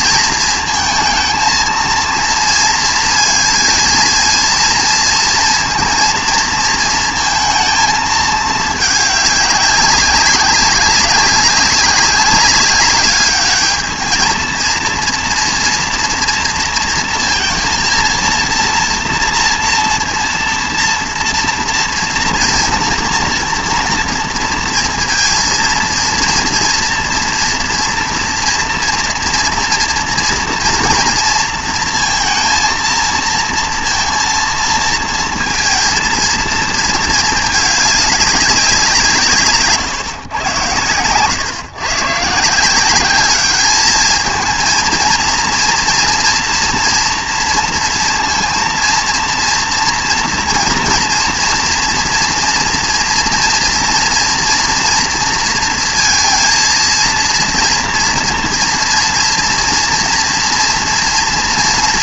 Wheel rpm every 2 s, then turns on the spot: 230, 230, 230, 230, 210, 190, 200, 220, 230, 230, 230, 230, 230, 230, 230, 230, 230, 230, 230, 200, 120, 160, 220, 230, 230, 230, 240, 240, 230, 230, 230.
none